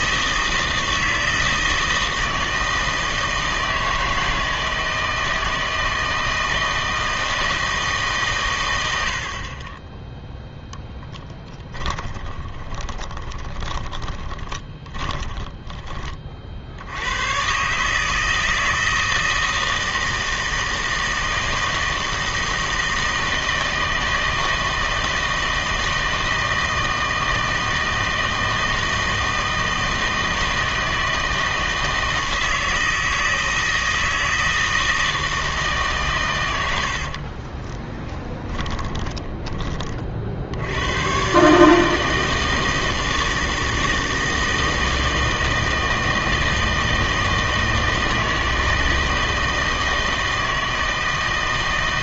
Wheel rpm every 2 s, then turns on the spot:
160, 160, 160, 160, 100, 0, 20, 20, 70, 160, 160, 160, 160, 160, 160, 160, 160, 160, 70, 10, 90, 160, 160, 160, 160, 160.
12-16 36-40